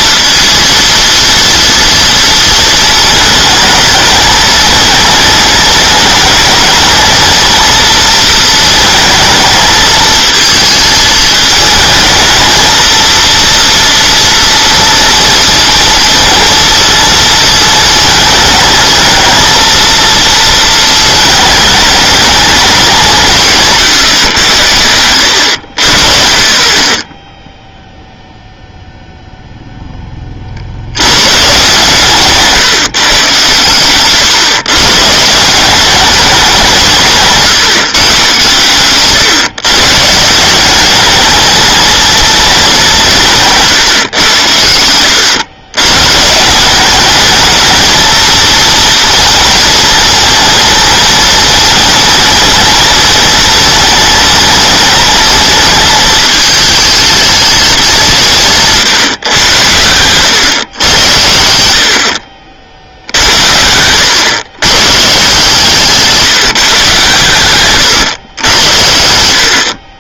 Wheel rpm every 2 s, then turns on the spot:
230, 220, 220, 220, 220, 220, 230, 240, 230, 220, 230, 200, 90, 30, 0, 60, 150, 140, 180, 130, 190, 190, 100, 190, 230, 230, 230, 220, 220, 150, 120, 70, 120, 150, 90.
none